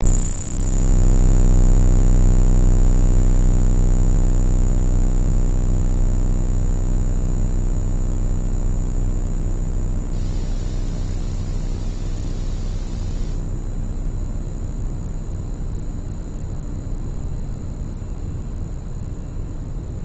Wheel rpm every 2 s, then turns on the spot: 0, 0, 0, 0, 0, 0, 0, 0, 0, 0.
none